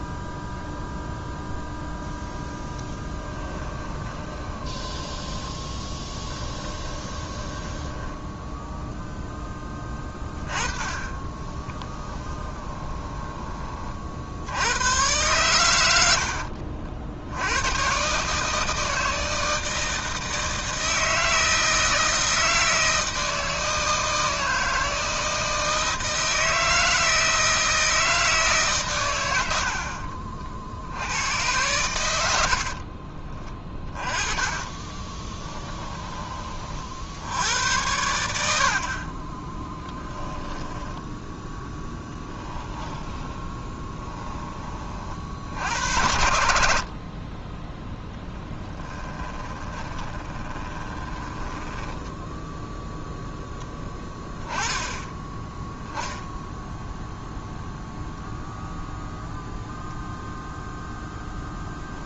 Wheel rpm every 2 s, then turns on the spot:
0, 10, 20, 20, 0, 20, 20, 110, 60, 160, 160, 160, 160, 160, 110, 80, 40, 20, 50, 60, 0, 10, 30, 60, 10, 20, 0, 10, 0, 0, 0.
2-8 12-14 32-36 42-44 48-52